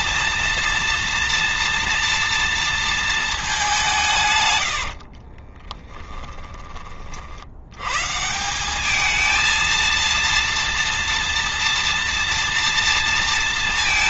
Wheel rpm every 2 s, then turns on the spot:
230, 230, 100, 30, 190, 230, 230.
4-6